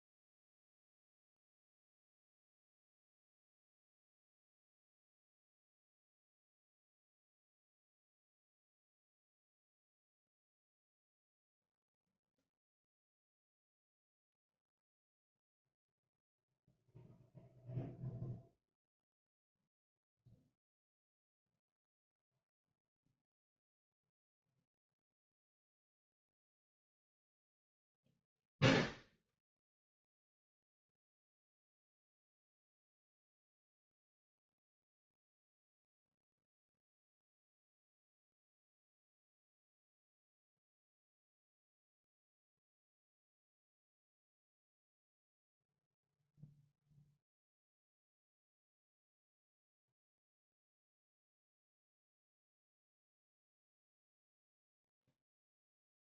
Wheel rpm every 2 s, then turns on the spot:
0, 0, 0, 0, 0, 0, 0, 0, 0, 0, 0, 0, 0, 0, 0, 0, 0, 0, 0, 0, 0, 0, 0, 0, 0, 0, 0, 0.
none